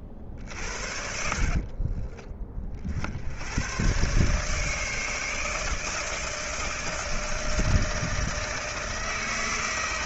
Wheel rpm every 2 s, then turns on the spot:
50, 30, 150, 160, 160.
none